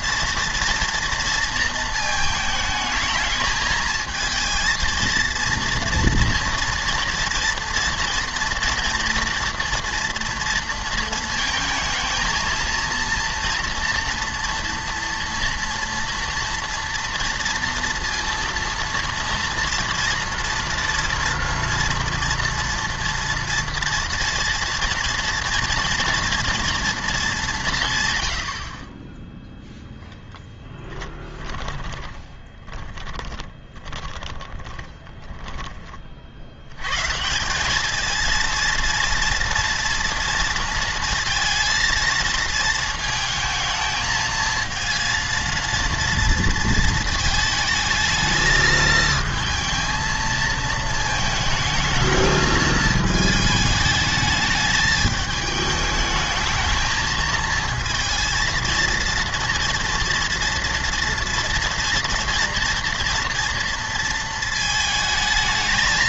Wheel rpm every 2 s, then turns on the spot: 230, 220, 230, 230, 240, 230, 230, 230, 230, 230, 230, 230, 230, 230, 50, 20, 30, 20, 100, 230, 230, 220, 220, 230, 220, 230, 220, 210, 220, 230, 230, 230, 220.
30-36